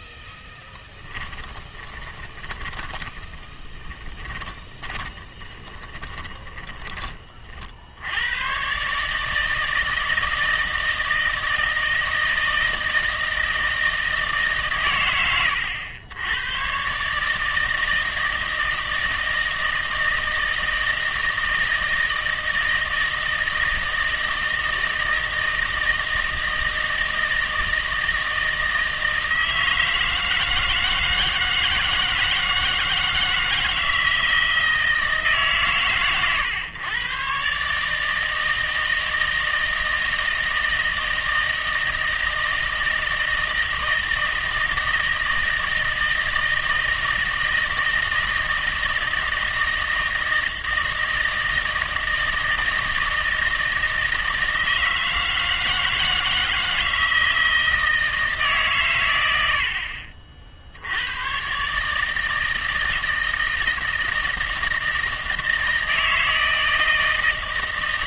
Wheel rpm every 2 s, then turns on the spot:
10, 20, 20, 20, 130, 160, 160, 130, 130, 160, 160, 160, 160, 160, 160, 160, 160, 160, 120, 160, 160, 160, 160, 160, 160, 160, 160, 160, 160, 120, 70, 160, 160, 160.
0-6